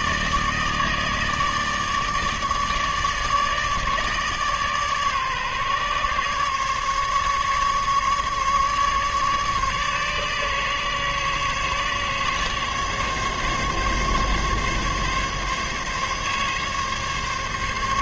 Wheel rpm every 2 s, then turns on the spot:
150, 150, 150, 140, 150, 140, 140, 140, 140.
none